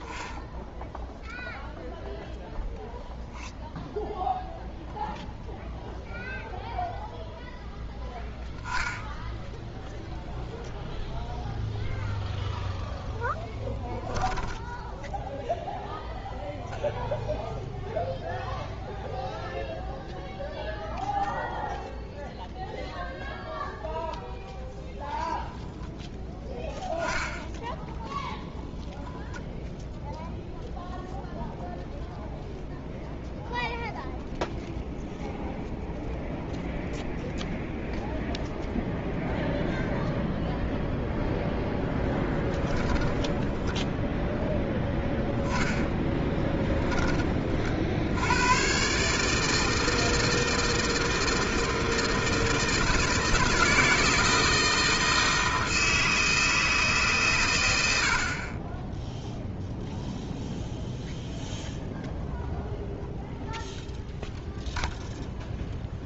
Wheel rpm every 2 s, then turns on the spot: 0, 0, 0, 0, 0, 0, 0, 10, 0, 0, 0, 0, 0, 10, 0, 0, 0, 0, 0, 0, 0, 0, 0, 20, 120, 160, 160, 160, 160, 20, 0, 0, 0.
14-16 26-28 46-48